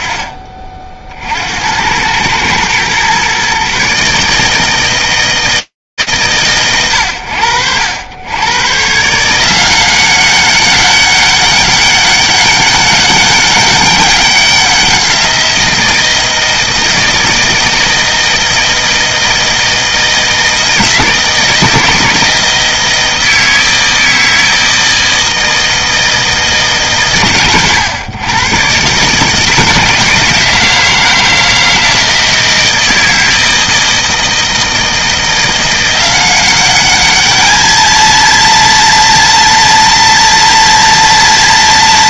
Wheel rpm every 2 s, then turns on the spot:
20, 110, 150, 110, 130, 200, 200, 180, 160, 160, 160, 160, 160, 140, 130, 160, 160, 160, 200, 230, 230.
none